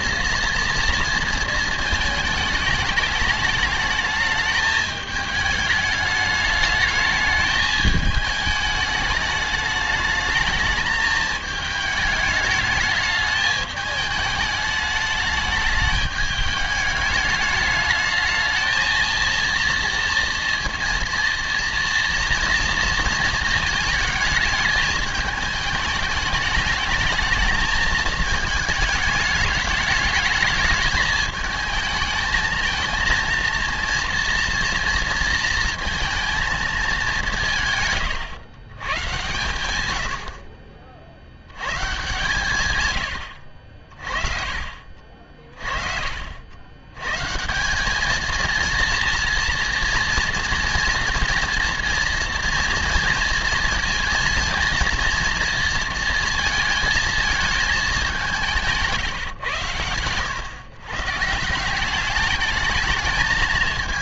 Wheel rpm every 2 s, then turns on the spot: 240, 220, 210, 210, 210, 220, 210, 210, 210, 220, 230, 230, 220, 210, 220, 220, 220, 230, 220, 120, 50, 130, 50, 90, 230, 240, 230, 230, 230, 170, 130, 220.
none